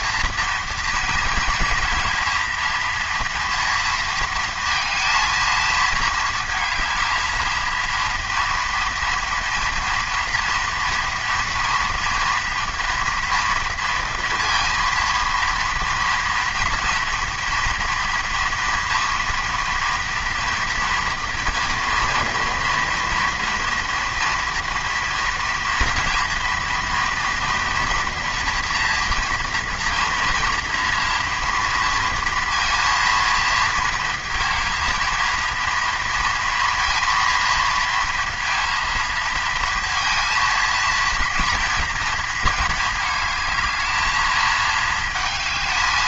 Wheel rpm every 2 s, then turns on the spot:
230, 230, 230, 220, 230, 230, 230, 230, 240, 230, 230, 230, 230, 230, 230, 230, 230, 230, 230, 230, 230, 220, 220.
none